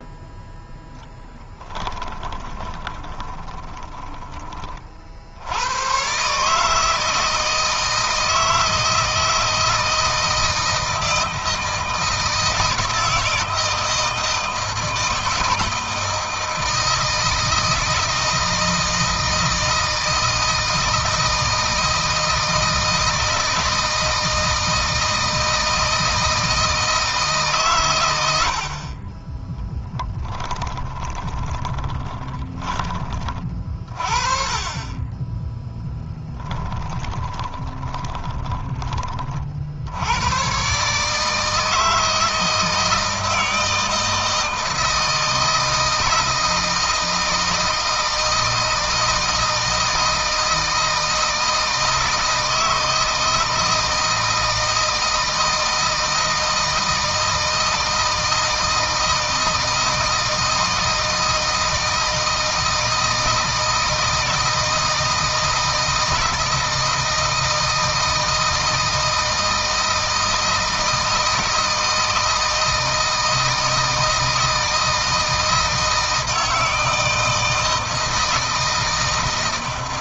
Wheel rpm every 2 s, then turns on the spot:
10, 20, 40, 160, 160, 160, 160, 160, 160, 160, 160, 160, 160, 160, 40, 20, 20, 20, 20, 20, 140, 160, 160, 160, 160, 160, 160, 160, 160, 160, 160, 160, 160, 160, 160, 160, 160, 160, 160, 160.
2-4 30-32 36-38